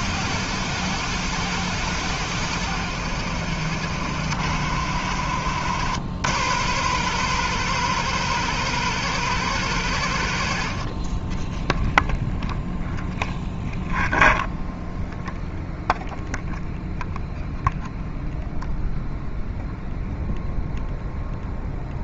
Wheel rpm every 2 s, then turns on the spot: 100, 90, 80, 110, 120, 50, 0, 0, 0, 0, 0.
none